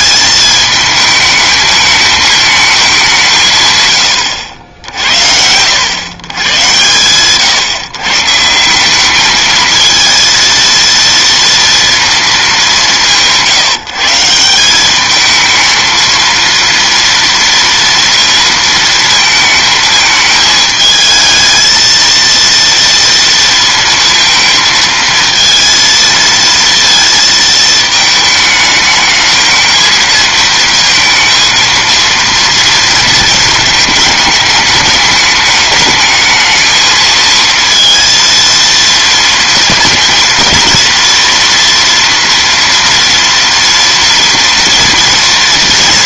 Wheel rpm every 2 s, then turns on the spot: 220, 220, 90, 110, 150, 230, 200, 180, 230, 230, 220, 230, 230, 230, 220, 230, 230, 210, 220, 230, 230, 230, 230.
none